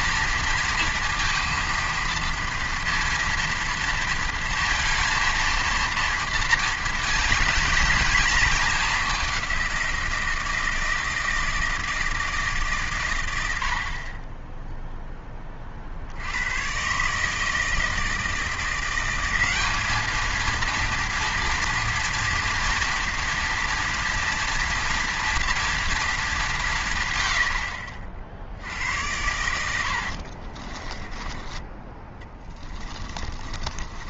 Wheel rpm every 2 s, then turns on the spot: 230, 230, 230, 230, 220, 160, 140, 10, 110, 170, 230, 230, 240, 200, 80, 40, 20.
30-34